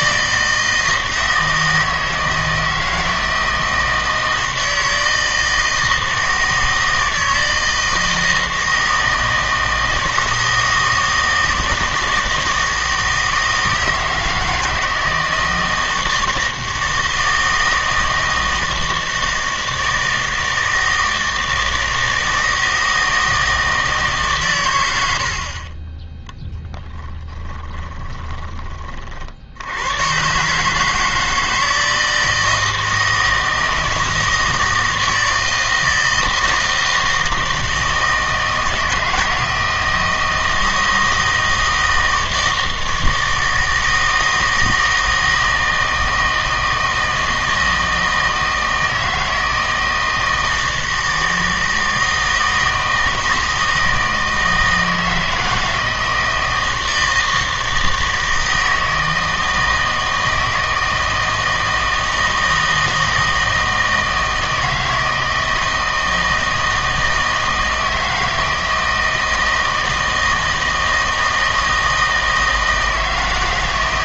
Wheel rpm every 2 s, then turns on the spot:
160, 160, 160, 160, 160, 160, 160, 160, 160, 160, 160, 160, 110, 10, 20, 150, 160, 160, 160, 160, 160, 160, 160, 160, 160, 160, 160, 160, 160, 160, 160, 160, 160, 160, 160, 160, 160.
26-28